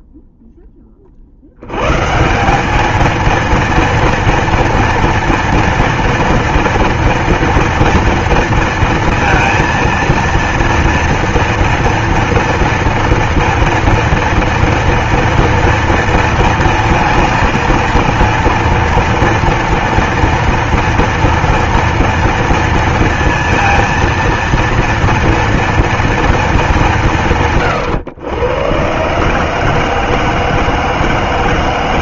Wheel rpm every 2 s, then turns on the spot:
10, 200, 230, 230, 230, 230, 230, 230, 230, 230, 230, 230, 230, 210, 120, 160.
none